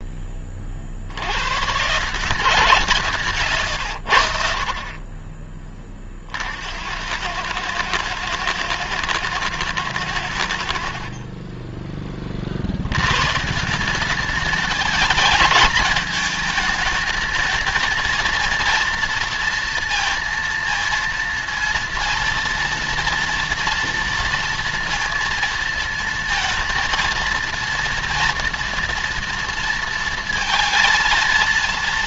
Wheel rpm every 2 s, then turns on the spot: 30, 160, 60, 60, 110, 80, 50, 210, 220, 230, 230, 230, 230, 230, 230, 230.
none